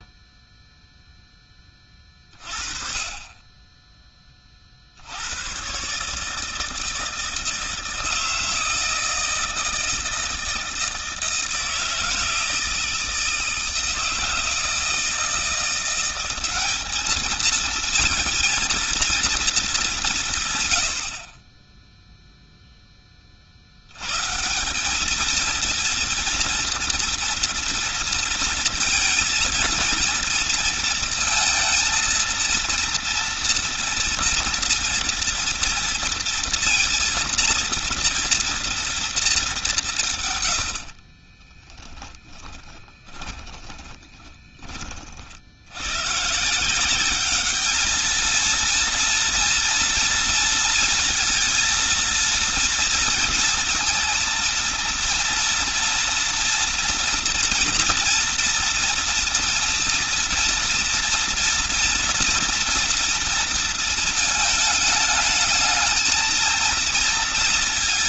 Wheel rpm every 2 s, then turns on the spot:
0, 30, 60, 160, 160, 160, 160, 160, 200, 230, 100, 10, 200, 230, 220, 230, 230, 230, 230, 230, 60, 20, 40, 180, 230, 230, 230, 230, 230, 230, 230, 230, 210, 230.
40-44